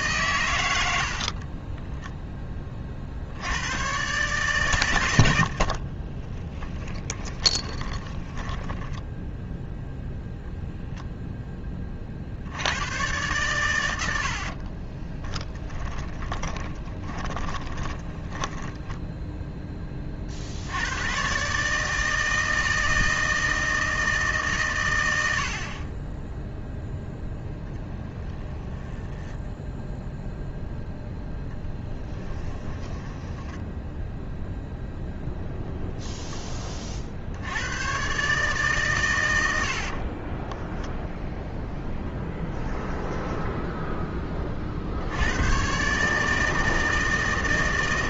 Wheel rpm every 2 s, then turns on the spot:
80, 30, 120, 20, 10, 0, 90, 40, 10, 10, 90, 160, 120, 0, 10, 0, 10, 0, 30, 130, 10, 10, 50, 160.
6-10 14-20 28-30 32-34 42-44